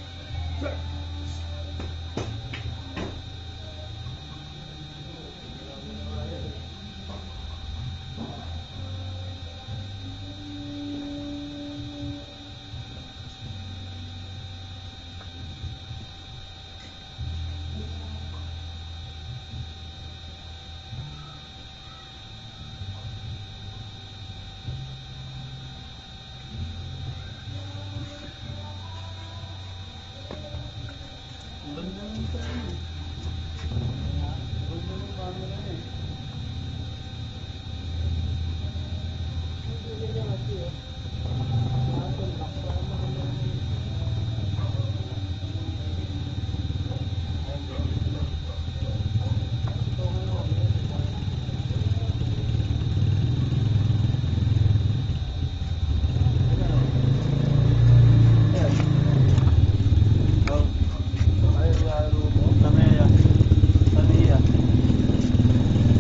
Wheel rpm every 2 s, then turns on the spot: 0, 0, 0, 0, 0, 0, 0, 0, 0, 0, 0, 0, 0, 0, 0, 0, 0, 0, 0, 0, 0, 0, 0, 0, 0, 0, 0, 0, 0, 0, 0, 0, 0.
none